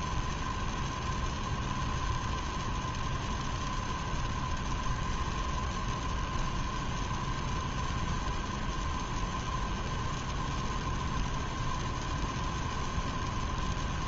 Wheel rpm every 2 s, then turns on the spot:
0, 0, 0, 0, 0, 0, 0.
none